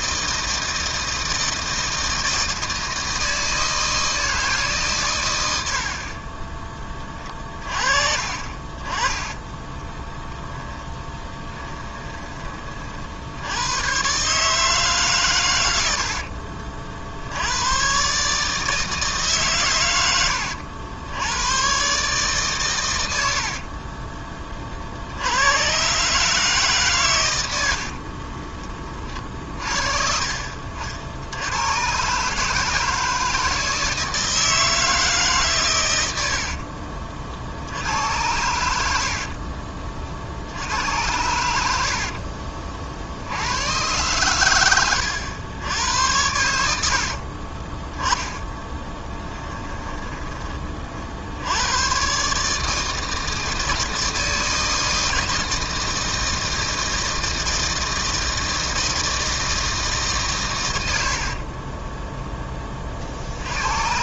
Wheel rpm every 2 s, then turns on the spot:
160, 160, 150, 30, 40, 10, 30, 150, 50, 160, 90, 120, 60, 140, 30, 50, 150, 160, 50, 80, 80, 50, 100, 70, 20, 40, 150, 160, 160, 160, 100, 30.
10-12 36-38 48-50